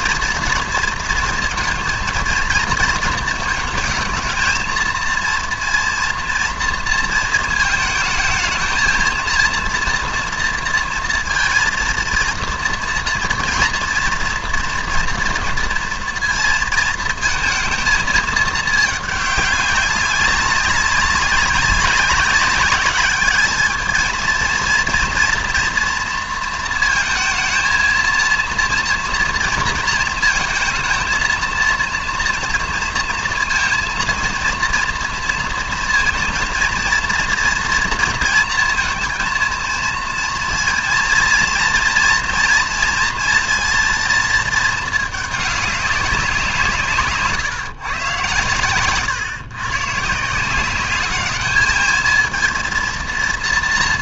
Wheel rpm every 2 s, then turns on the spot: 230, 230, 220, 230, 220, 230, 230, 230, 220, 210, 200, 190, 230, 230, 230, 230, 230, 230, 230, 230, 230, 230, 220, 170, 120, 190, 230.
none